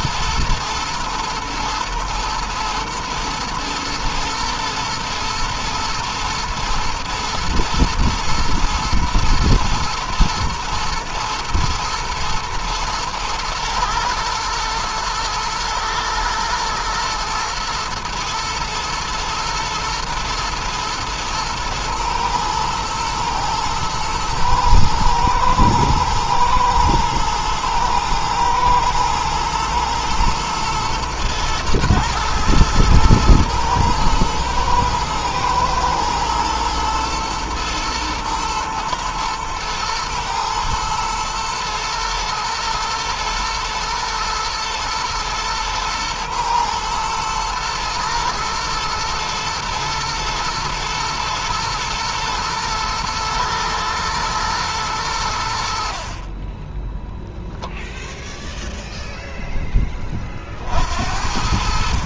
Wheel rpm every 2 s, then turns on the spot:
110, 120, 120, 120, 110, 120, 110, 110, 120, 110, 110, 110, 110, 120, 110, 110, 110, 110, 120, 120, 110, 110, 120, 120, 110, 110, 120, 110, 10, 0, 50.
none